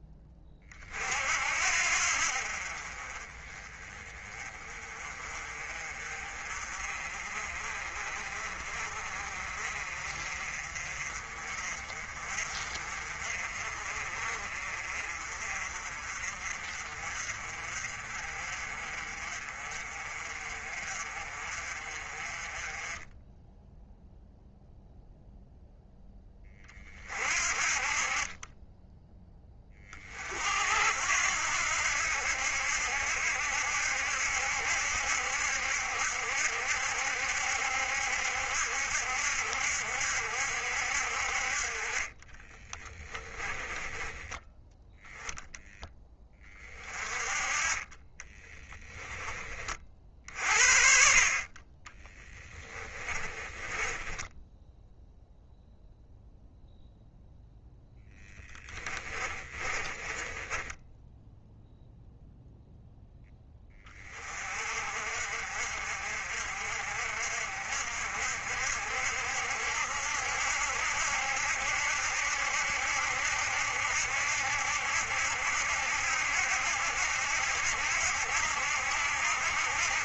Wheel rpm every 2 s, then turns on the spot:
40, 40, 30, 40, 40, 40, 40, 40, 40, 40, 40, 20, 0, 30, 10, 70, 70, 70, 70, 70, 60, 20, 0, 30, 10, 50, 30, 0, 0, 20, 10, 0, 50, 50, 60, 70, 70, 70, 70, 70.
42-44 52-54 58-62